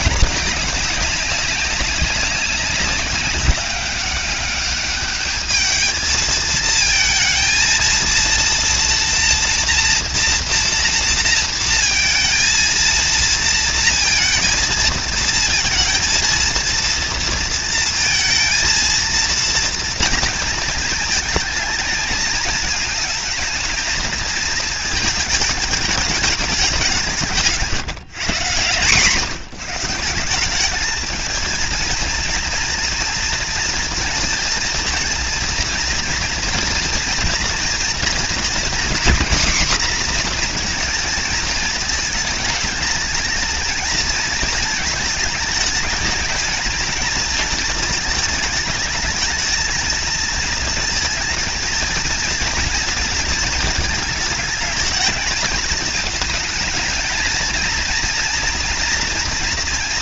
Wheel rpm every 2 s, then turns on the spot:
200, 190, 200, 220, 230, 230, 230, 230, 230, 230, 220, 220, 220, 180, 150, 210, 240, 230, 230, 240, 240, 210, 220, 230, 220, 230, 230, 220, 220, 230.
none